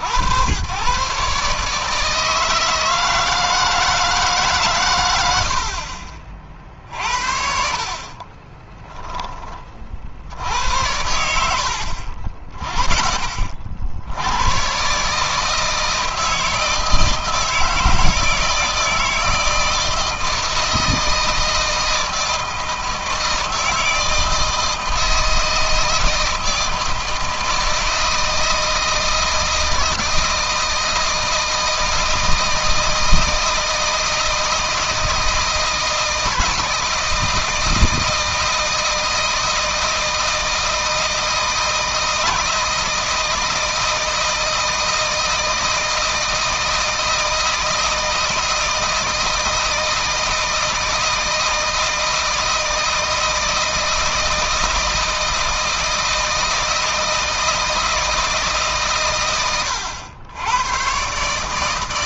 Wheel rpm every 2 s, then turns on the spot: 110, 160, 120, 50, 10, 70, 30, 120, 160, 160, 160, 160, 160, 160, 160, 160, 160, 160, 160, 160, 160, 160, 160, 160, 160, 160, 160, 160, 160, 140, 120.
8-10